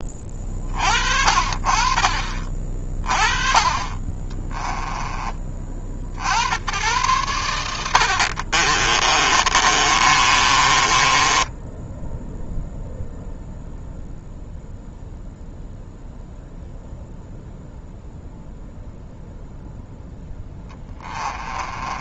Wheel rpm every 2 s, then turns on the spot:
50, 30, 20, 110, 30, 20, 0, 0, 0, 0, 20.
8-12 20-22